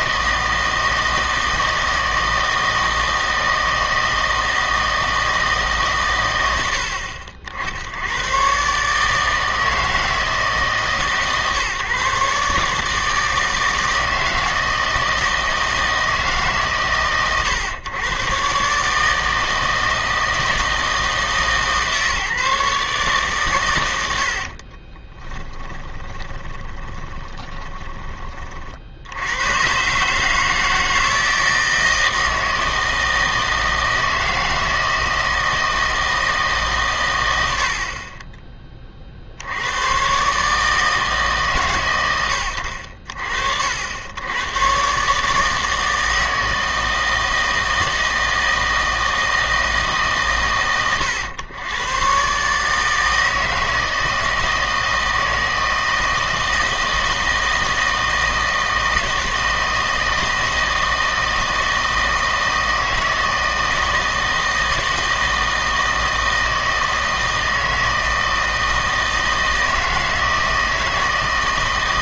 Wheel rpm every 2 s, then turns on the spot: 160, 160, 160, 70, 140, 150, 150, 160, 140, 140, 160, 140, 50, 20, 50, 160, 160, 160, 140, 20, 150, 80, 120, 160, 160, 100, 150, 160, 160, 160, 160, 160, 160, 160, 160, 160.
24-28